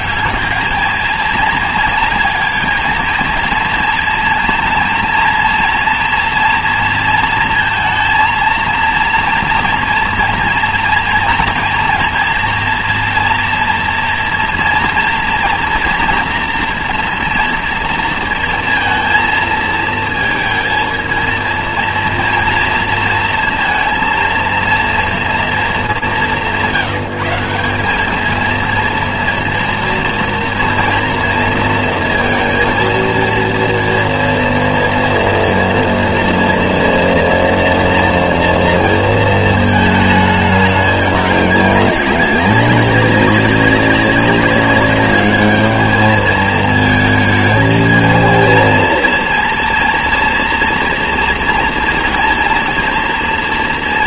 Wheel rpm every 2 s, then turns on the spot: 210, 230, 230, 230, 230, 230, 230, 230, 230, 230, 230, 230, 230, 160, 230, 230, 230, 240, 230, 230, 210, 200, 200, 220, 230, 230, 230.
none